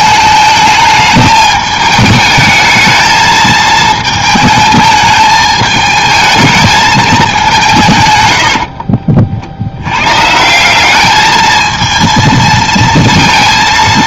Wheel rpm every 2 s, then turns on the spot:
220, 220, 220, 220, 70, 170, 230.
8-10